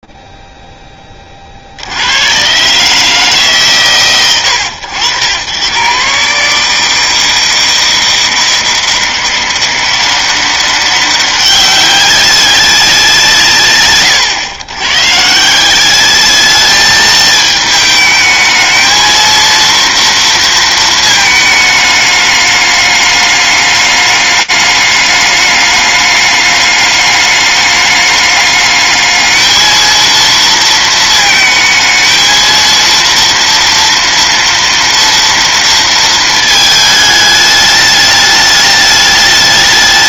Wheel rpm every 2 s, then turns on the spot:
0, 50, 130, 110, 160, 180, 190, 130, 180, 220, 230, 210, 210, 210, 210, 220, 220, 230, 230, 210.
none